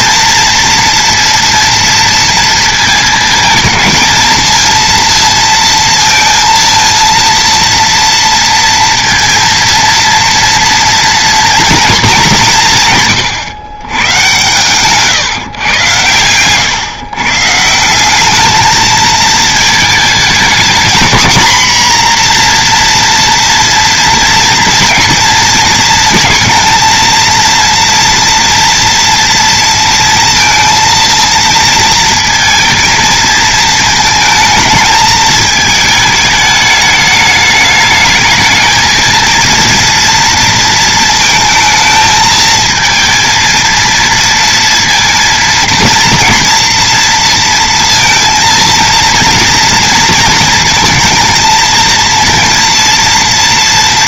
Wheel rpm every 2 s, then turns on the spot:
230, 230, 230, 230, 230, 230, 170, 130, 130, 220, 230, 240, 230, 230, 230, 230, 230, 220, 210, 220, 230, 220, 230, 230, 230, 220, 230.
none